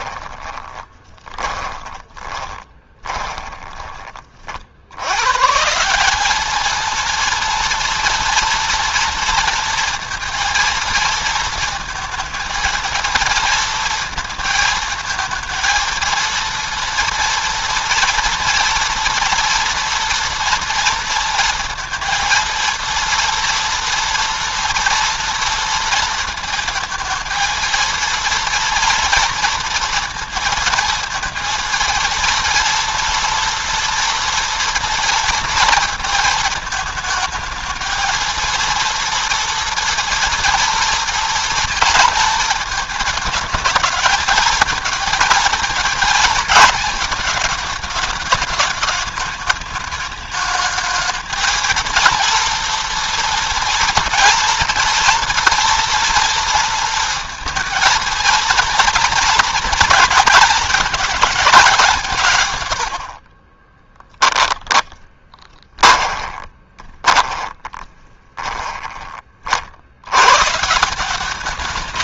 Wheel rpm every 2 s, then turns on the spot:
20, 20, 80, 230, 230, 230, 230, 230, 230, 230, 230, 230, 230, 220, 230, 230, 230, 230, 220, 230, 230, 220, 230, 230, 210, 220, 230, 240, 230, 230, 230, 110, 10, 20, 20, 170.
0-4 64-68